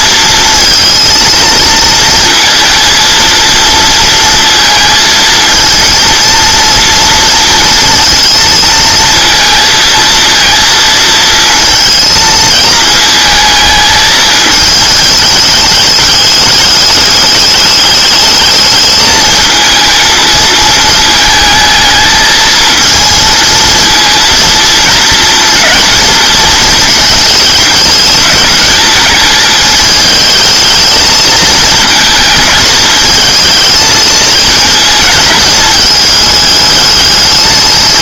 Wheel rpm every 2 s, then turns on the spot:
230, 230, 220, 230, 220, 230, 220, 220, 210, 210, 230, 220, 220, 220, 220, 220, 220, 220, 210.
none